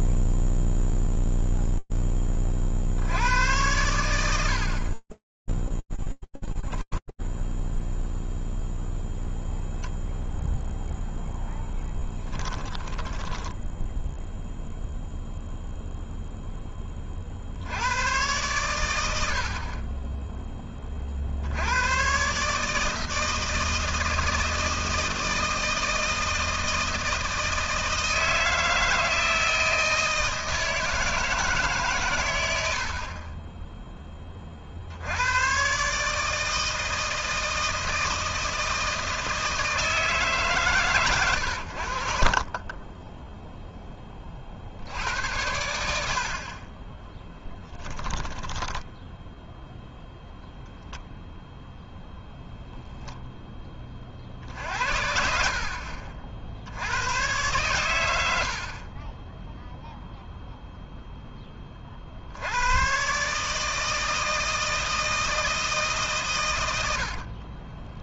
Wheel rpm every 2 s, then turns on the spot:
0, 0, 100, 20, 0, 0, 10, 0, 10, 110, 20, 150, 160, 160, 160, 160, 60, 90, 160, 160, 120, 10, 90, 10, 0, 0, 10, 60, 120, 0, 10, 150, 160, 40.
6-8 12-14 46-48 66-68